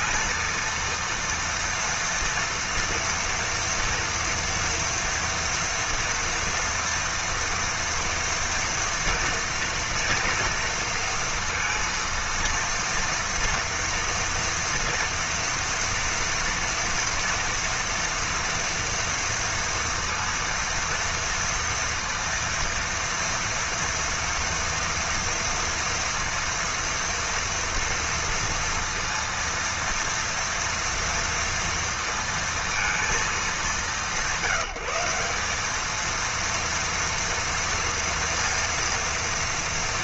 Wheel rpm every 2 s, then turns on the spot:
230, 230, 240, 230, 230, 230, 230, 230, 230, 230, 230, 230, 230, 230, 230, 230, 230, 170, 230, 230.
none